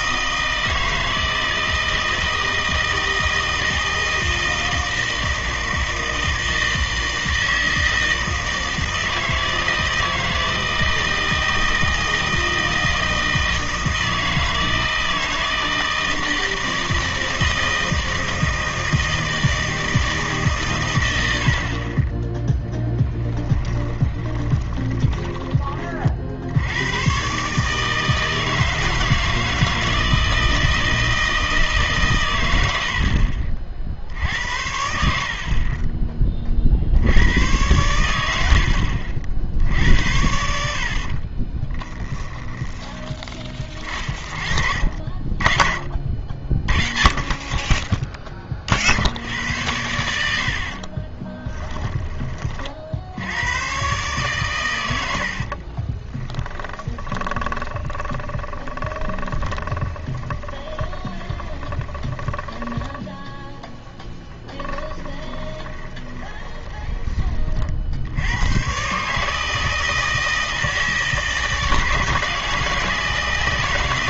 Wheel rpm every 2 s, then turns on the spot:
160, 160, 160, 160, 160, 160, 160, 160, 160, 160, 140, 10, 20, 80, 160, 160, 90, 70, 40, 70, 70, 10, 40, 40, 40, 70, 40, 110, 10, 20, 20, 20, 20, 20, 110, 160, 160.
24-26 56-68